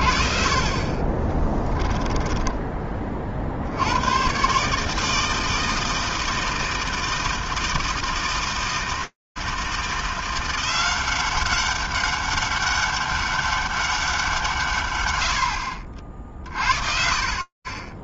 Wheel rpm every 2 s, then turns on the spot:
60, 10, 150, 160, 160, 180, 200, 140, 50.
2-4